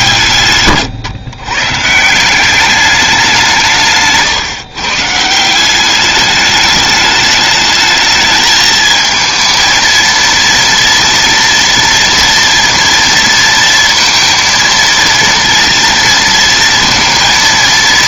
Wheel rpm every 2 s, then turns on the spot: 110, 200, 140, 210, 220, 230, 230, 230, 230.
none